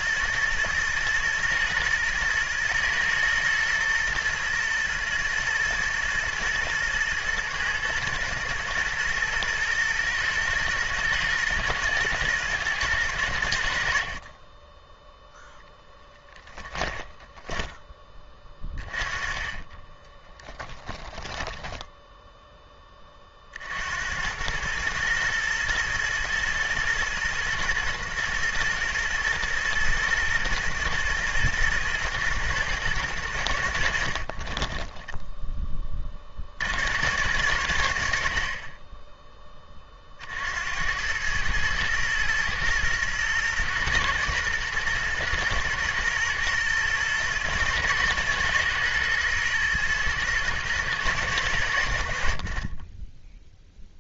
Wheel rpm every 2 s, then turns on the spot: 110, 120, 120, 120, 110, 110, 110, 10, 10, 20, 10, 20, 110, 120, 110, 110, 110, 20, 80, 30, 80, 110, 110, 120, 120, 120, 30.
16-18 20-22 34-36